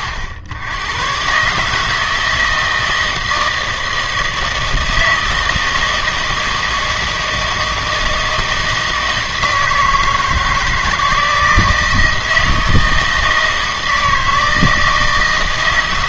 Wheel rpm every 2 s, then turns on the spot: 100, 160, 160, 160, 160, 160, 160, 160.
none